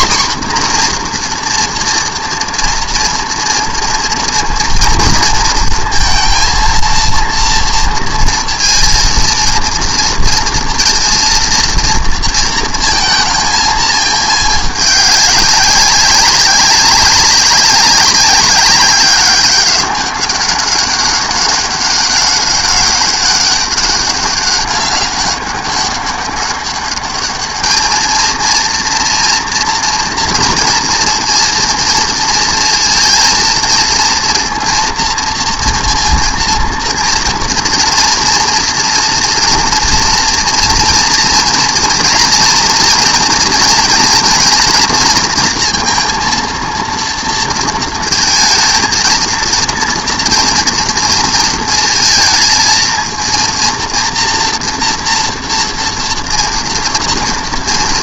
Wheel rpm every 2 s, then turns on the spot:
250, 230, 230, 230, 230, 230, 230, 210, 190, 200, 200, 200, 200, 200, 230, 230, 230, 230, 230, 230, 230, 230, 230, 230, 230, 230, 220, 240, 230.
none